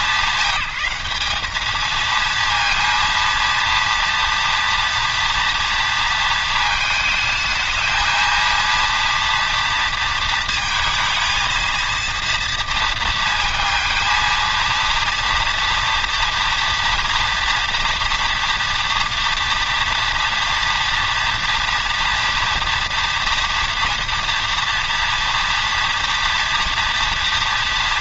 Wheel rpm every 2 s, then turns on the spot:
180, 230, 230, 220, 230, 220, 230, 230, 230, 230, 230, 230, 230, 240.
none